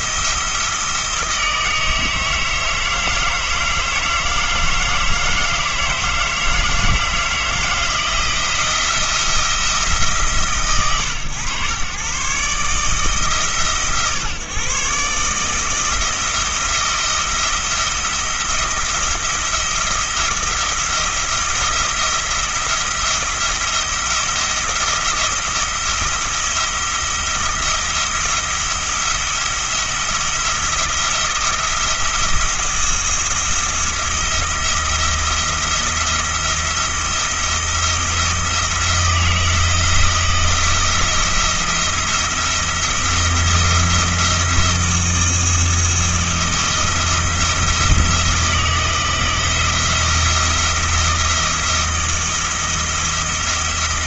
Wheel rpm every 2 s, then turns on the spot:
160, 160, 160, 160, 170, 110, 150, 140, 170, 170, 170, 170, 170, 170, 170, 170, 170, 170, 170, 170, 160, 170, 170, 170, 160, 170, 170.
none